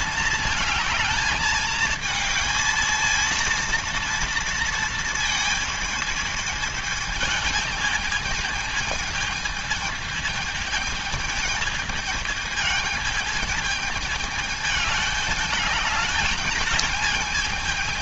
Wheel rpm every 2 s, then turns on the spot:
220, 220, 230, 220, 220, 220, 220, 210, 210.
none